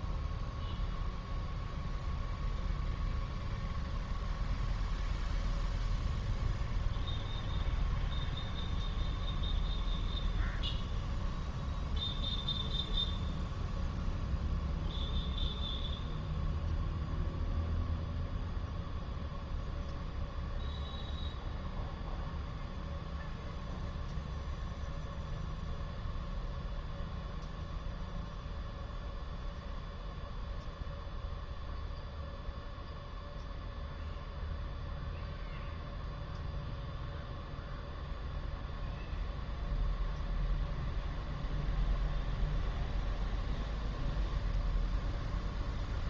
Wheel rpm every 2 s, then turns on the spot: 0, 0, 0, 0, 0, 0, 0, 0, 0, 0, 0, 0, 0, 0, 0, 0, 0, 0, 0, 0, 0, 0, 0.
none